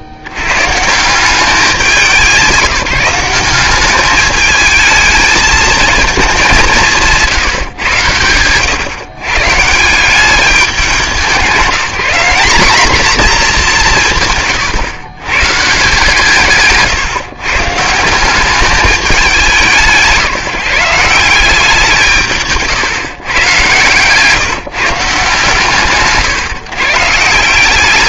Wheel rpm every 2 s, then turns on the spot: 70, 190, 220, 190, 120, 190, 210, 130, 150, 200, 170, 150, 140, 150.
none